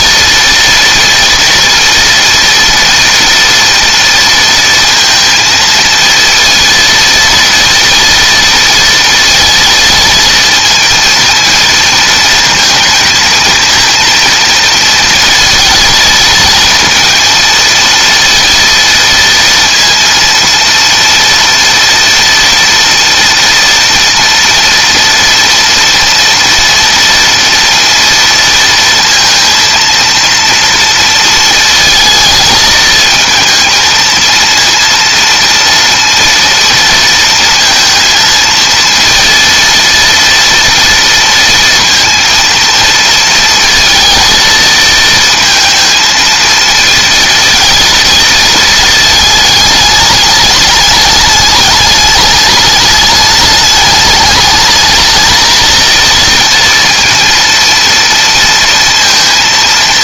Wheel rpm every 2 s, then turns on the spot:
230, 230, 230, 230, 230, 230, 220, 220, 230, 230, 230, 230, 230, 230, 230, 230, 220, 230, 230, 230, 230, 230, 230, 230, 220, 210, 210, 210, 230, 230.
none